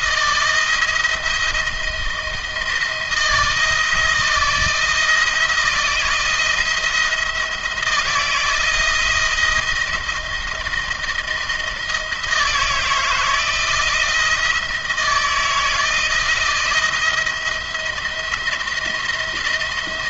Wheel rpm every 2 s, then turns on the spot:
170, 160, 160, 160, 160, 170, 170, 160, 170, 170.
none